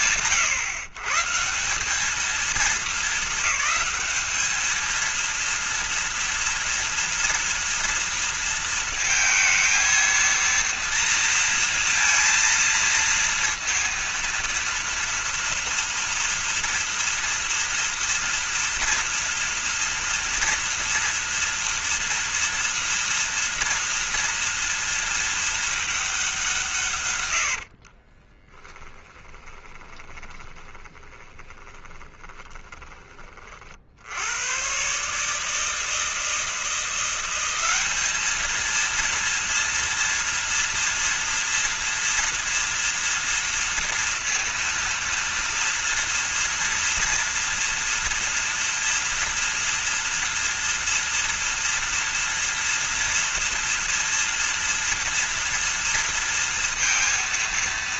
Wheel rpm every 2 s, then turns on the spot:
140, 220, 230, 230, 220, 230, 230, 240, 230, 230, 230, 230, 220, 110, 20, 10, 30, 150, 180, 230, 230, 230, 230, 230, 230, 230, 230, 230, 230.
28-30